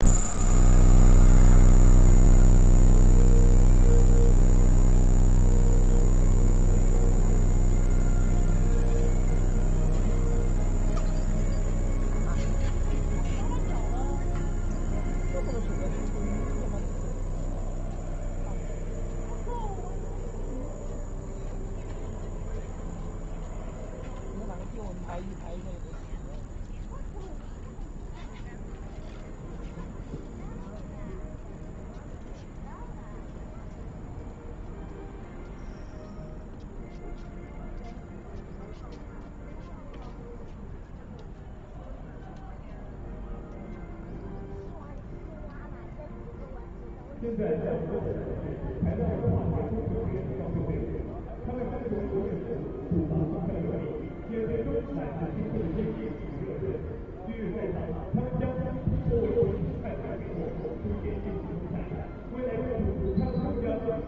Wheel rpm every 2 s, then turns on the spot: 0, 0, 0, 0, 0, 0, 0, 0, 0, 0, 0, 0, 0, 0, 0, 0, 0, 0, 0, 0, 0, 0, 0, 0, 0, 0, 0, 0, 0, 0, 0, 0.
none